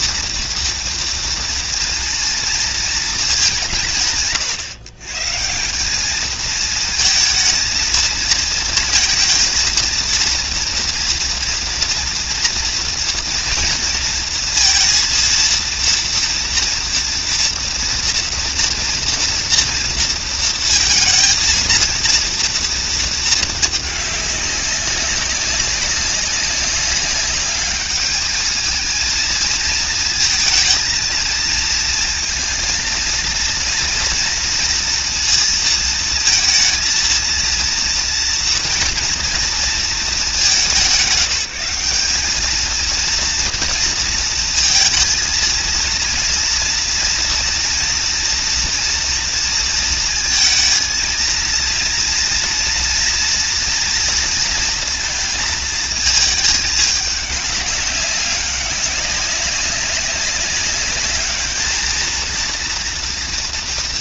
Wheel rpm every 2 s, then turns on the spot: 230, 220, 140, 220, 230, 230, 230, 230, 230, 230, 230, 220, 200, 200, 220, 220, 230, 230, 230, 230, 180, 230, 230, 230, 230, 230, 230, 230, 210, 190, 200, 240.
none